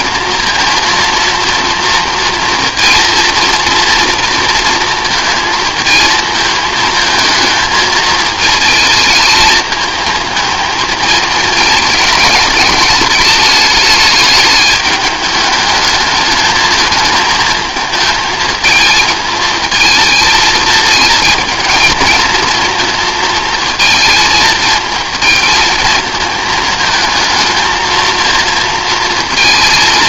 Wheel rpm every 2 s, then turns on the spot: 230, 230, 230, 220, 220, 220, 210, 210, 210, 220, 220, 230, 220, 230, 230.
none